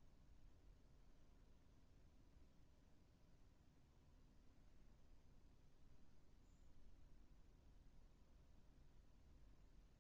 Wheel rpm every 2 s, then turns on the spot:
0, 0, 0, 0, 0.
none